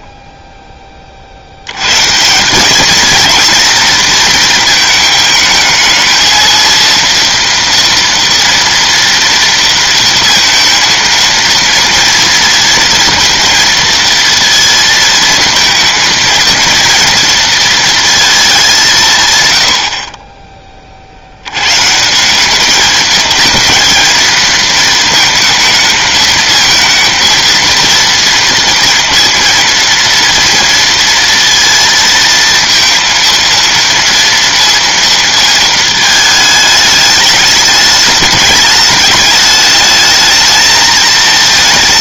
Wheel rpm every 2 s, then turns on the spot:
40, 230, 220, 230, 230, 230, 230, 230, 230, 140, 50, 210, 230, 230, 230, 230, 230, 230, 210, 210, 220.
none